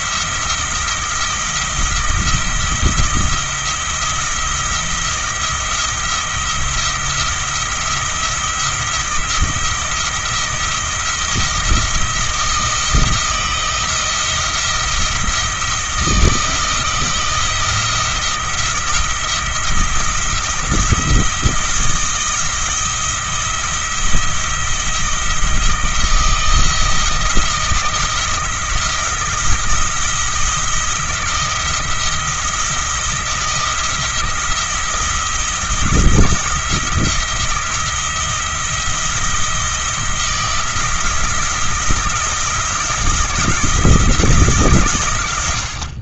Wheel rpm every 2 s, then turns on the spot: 170, 170, 170, 170, 170, 170, 160, 170, 160, 170, 170, 170, 170, 170, 170, 170, 170, 170, 160, 170, 170, 170, 130.
none